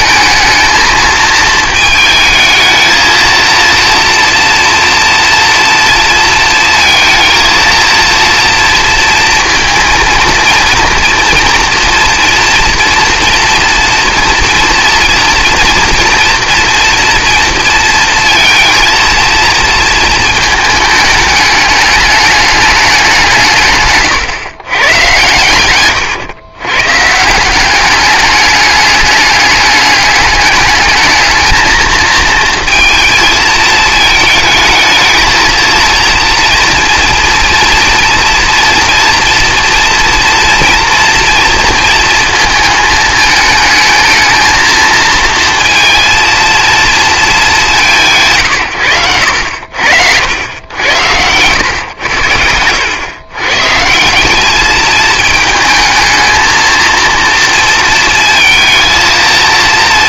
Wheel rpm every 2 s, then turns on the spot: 220, 220, 230, 230, 230, 230, 230, 230, 240, 230, 220, 210, 120, 110, 200, 210, 220, 220, 230, 230, 230, 220, 220, 230, 140, 80, 100, 190, 220, 230.
none